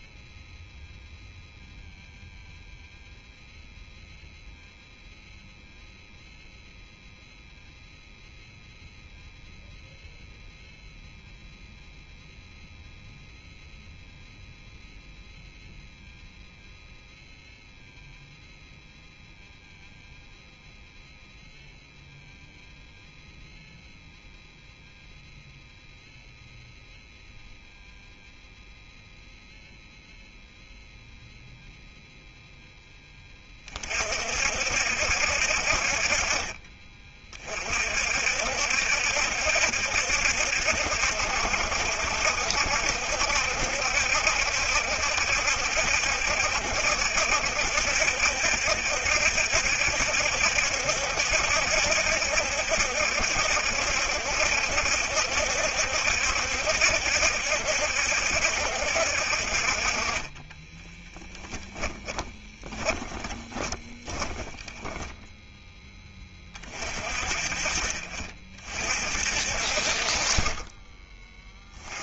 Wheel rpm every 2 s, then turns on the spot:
0, 0, 0, 0, 0, 0, 0, 0, 0, 0, 0, 0, 0, 0, 0, 0, 10, 60, 30, 60, 60, 70, 70, 70, 70, 70, 70, 70, 70, 60, 20, 20, 20, 40, 40, 30.
60-66